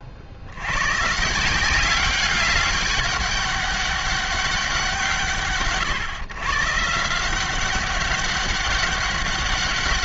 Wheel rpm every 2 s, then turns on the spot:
110, 200, 180, 140, 200.
none